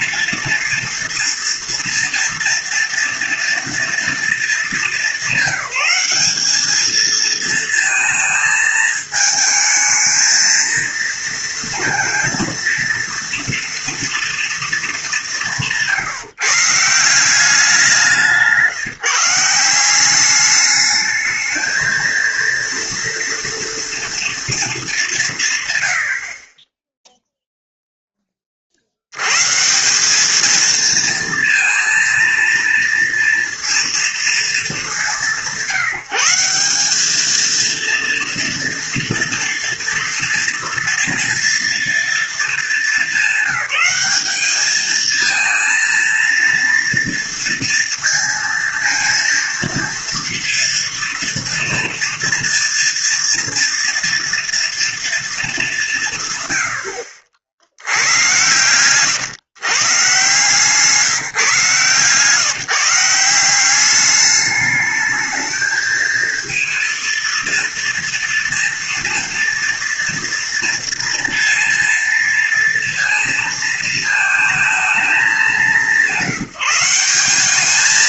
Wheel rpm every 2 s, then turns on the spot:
230, 240, 220, 210, 220, 230, 230, 230, 150, 160, 210, 230, 220, 20, 40, 220, 230, 210, 190, 230, 230, 220, 210, 230, 230, 230, 230, 230, 100, 120, 150, 150, 210, 230, 230, 230, 230, 230, 180.
58-60